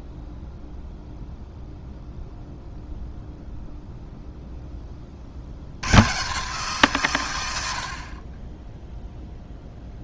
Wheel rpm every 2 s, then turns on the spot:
0, 0, 20, 140, 0.
none